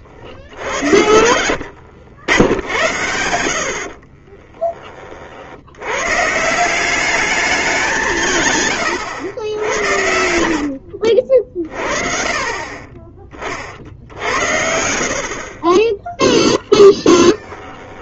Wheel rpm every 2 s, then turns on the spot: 80, 100, 30, 160, 120, 60, 30, 70, 10.
0-2 4-6 16-18